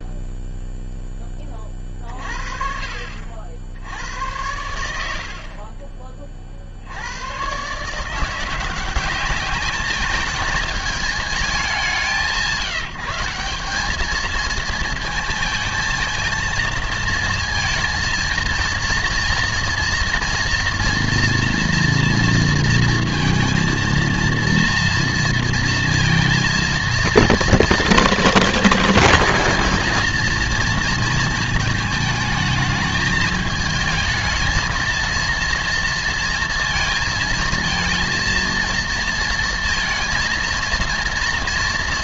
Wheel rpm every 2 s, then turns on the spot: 0, 50, 90, 40, 180, 210, 160, 220, 220, 230, 230, 230, 230, 230, 220, 230, 210, 220, 230, 230, 230.
none